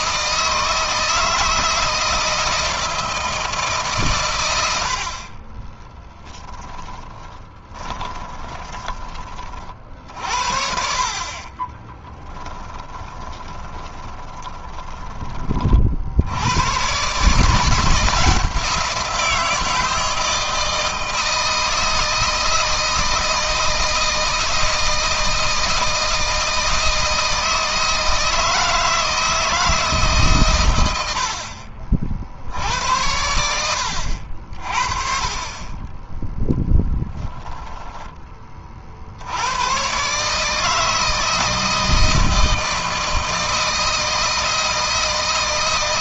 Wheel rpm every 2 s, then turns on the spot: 160, 160, 70, 20, 30, 60, 20, 20, 120, 160, 160, 160, 160, 160, 160, 90, 80, 40, 10, 50, 160, 160, 160.
6-8 10-14